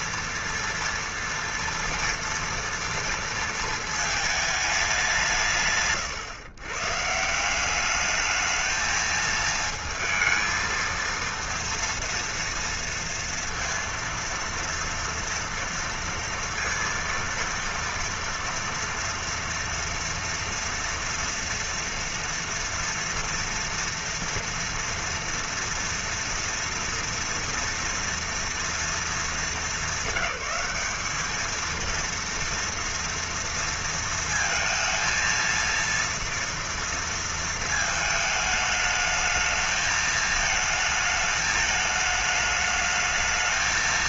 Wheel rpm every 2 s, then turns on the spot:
230, 230, 200, 150, 220, 230, 230, 230, 230, 230, 230, 230, 230, 230, 220, 200, 230, 220, 230, 210, 220, 210.
none